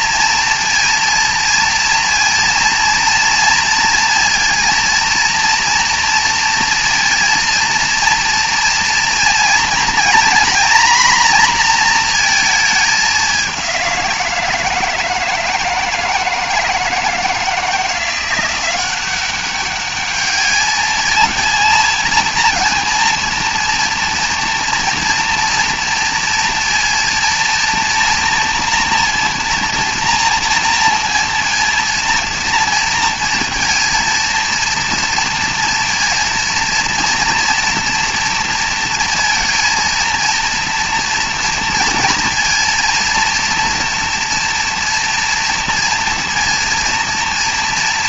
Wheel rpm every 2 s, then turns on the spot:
230, 230, 230, 230, 240, 240, 210, 160, 160, 180, 220, 230, 230, 230, 230, 230, 230, 230, 230, 230, 230, 230, 230, 230.
none